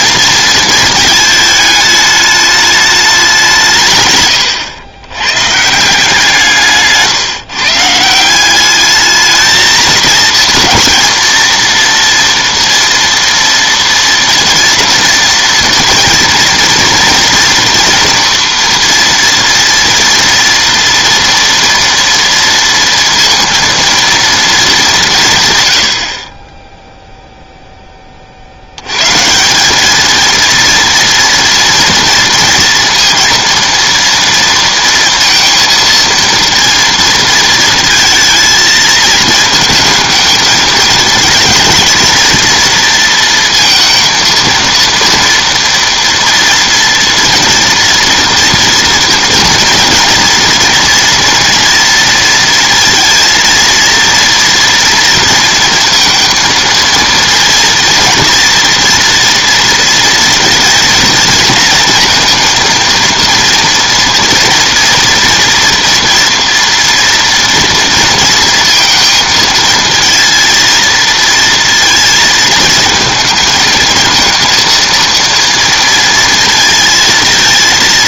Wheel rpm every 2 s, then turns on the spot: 230, 210, 100, 160, 200, 230, 230, 230, 230, 230, 230, 230, 200, 10, 80, 230, 230, 230, 230, 220, 220, 230, 230, 240, 230, 240, 230, 230, 230, 230, 230, 230, 240, 230, 230, 230, 220, 230, 230.
none